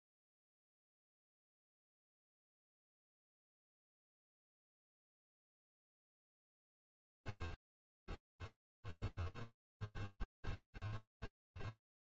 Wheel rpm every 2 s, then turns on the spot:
0, 0, 0, 0, 0, 0.
none